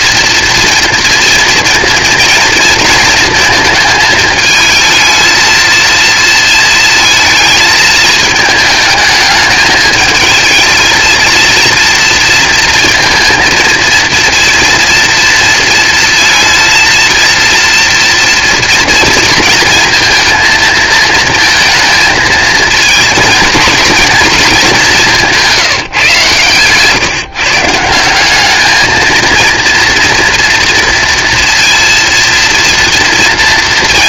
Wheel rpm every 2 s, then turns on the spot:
230, 230, 220, 230, 220, 220, 230, 230, 230, 230, 220, 220, 210, 120, 210, 230, 230.
none